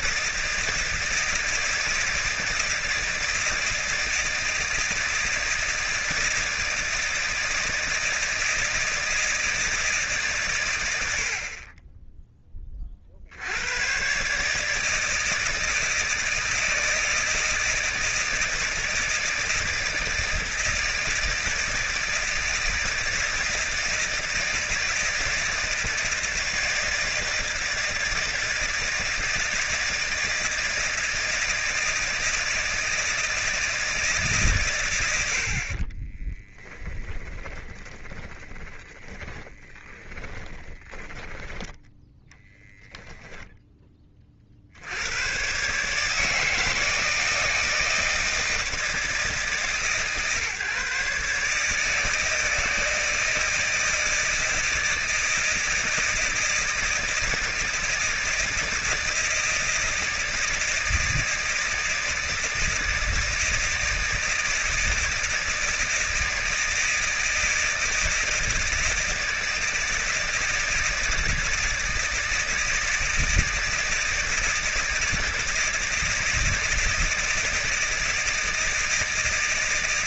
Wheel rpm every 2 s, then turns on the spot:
160, 160, 160, 160, 160, 100, 30, 160, 160, 160, 160, 160, 160, 160, 160, 160, 160, 120, 10, 20, 10, 10, 80, 160, 160, 140, 160, 160, 160, 160, 160, 170, 160, 160, 160, 160, 160, 160, 160, 160.
36-42